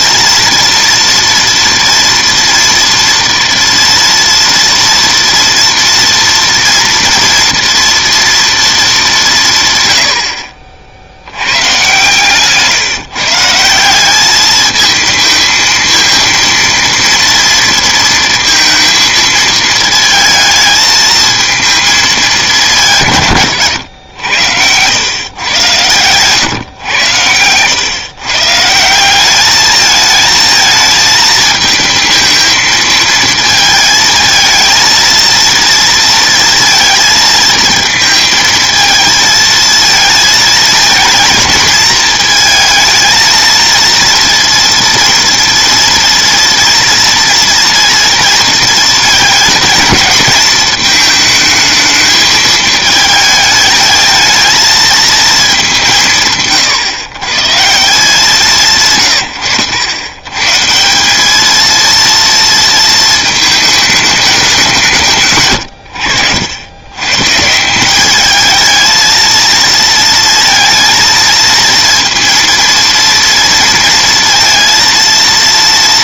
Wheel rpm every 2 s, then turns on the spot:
230, 230, 230, 230, 220, 60, 140, 220, 230, 230, 220, 170, 100, 110, 160, 220, 220, 230, 230, 220, 220, 220, 230, 230, 230, 220, 220, 220, 130, 140, 160, 230, 180, 100, 220, 230, 230, 230.
none